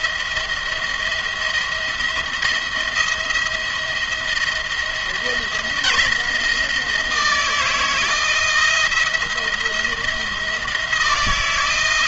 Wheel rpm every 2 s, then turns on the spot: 160, 170, 170, 160, 170, 160.
none